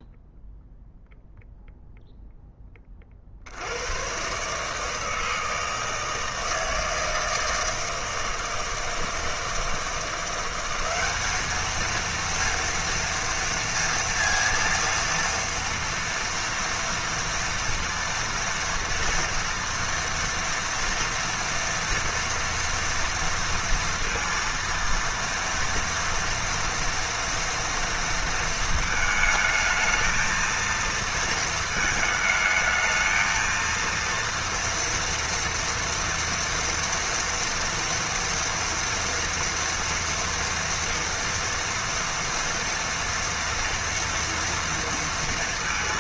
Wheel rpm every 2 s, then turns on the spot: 0, 20, 150, 160, 160, 200, 230, 230, 230, 230, 230, 230, 230, 230, 220, 230, 220, 230, 230, 230, 240, 230, 230.
none